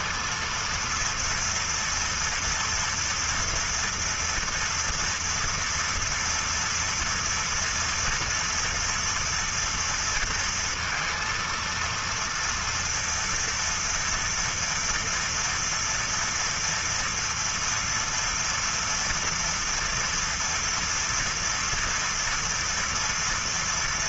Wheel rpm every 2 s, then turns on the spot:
230, 230, 230, 230, 230, 230, 230, 230, 240, 240, 230, 230.
none